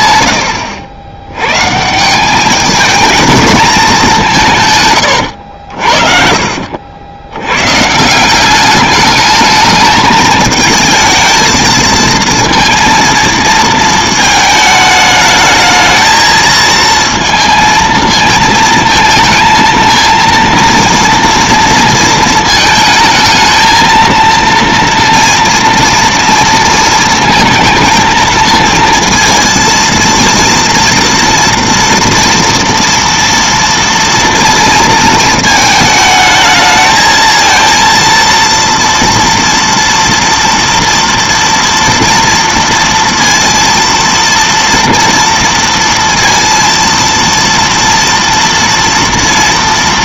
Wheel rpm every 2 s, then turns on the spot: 90, 210, 150, 70, 200, 220, 230, 220, 220, 220, 230, 220, 230, 230, 230, 230, 230, 230, 220, 230, 230, 230, 230, 230, 230.
none